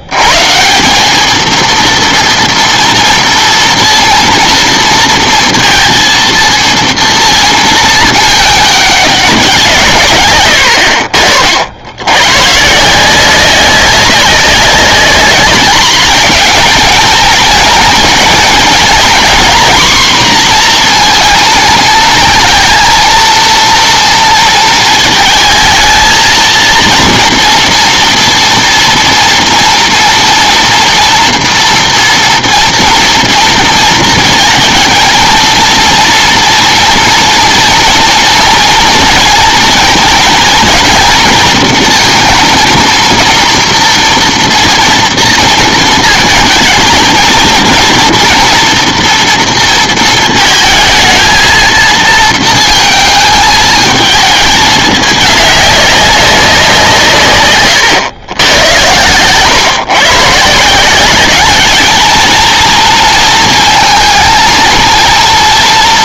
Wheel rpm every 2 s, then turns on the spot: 160, 230, 230, 230, 210, 90, 140, 190, 230, 230, 240, 230, 230, 220, 230, 230, 230, 230, 230, 230, 230, 230, 230, 220, 230, 220, 220, 210, 180, 100, 160, 230, 230.
none